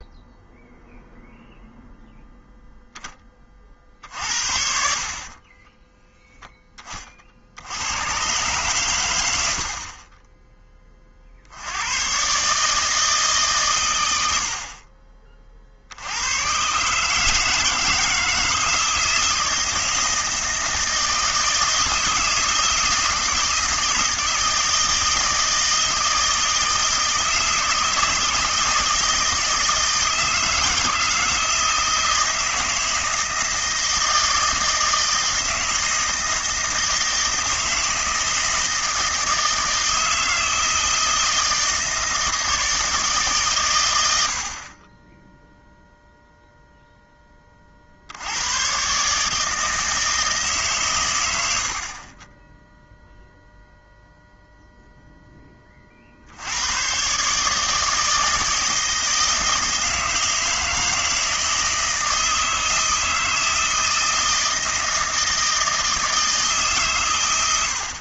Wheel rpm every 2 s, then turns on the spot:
0, 0, 60, 20, 120, 20, 150, 50, 130, 160, 160, 160, 160, 160, 160, 160, 160, 160, 160, 160, 160, 160, 40, 0, 110, 130, 10, 0, 100, 160, 160, 160, 160, 150.
none